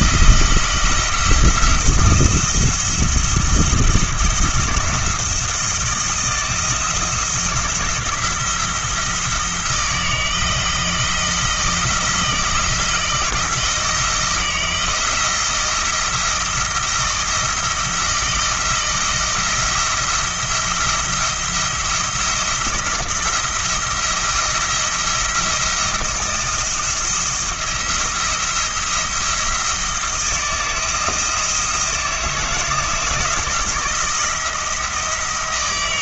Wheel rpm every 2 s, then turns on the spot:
170, 170, 170, 170, 170, 160, 160, 160, 170, 160, 170, 170, 170, 170, 170, 170, 160, 170.
none